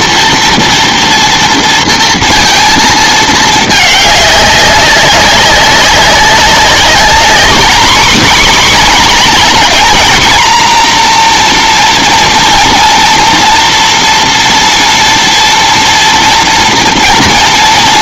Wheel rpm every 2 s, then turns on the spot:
230, 230, 200, 210, 260, 230, 230, 230, 230.
none